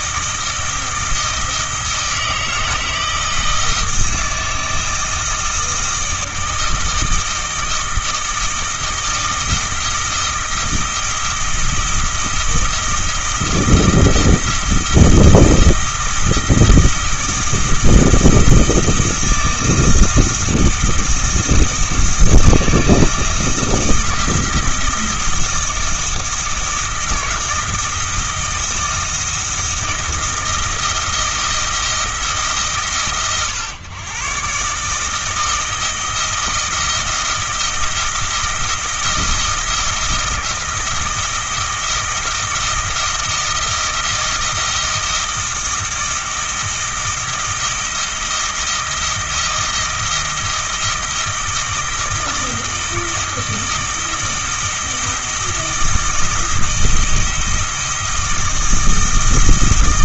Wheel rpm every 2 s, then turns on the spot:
160, 160, 160, 160, 160, 160, 170, 160, 160, 160, 160, 160, 160, 160, 170, 160, 140, 140, 160, 160, 170, 160, 170, 160, 170, 160, 160, 160, 160, 160.
none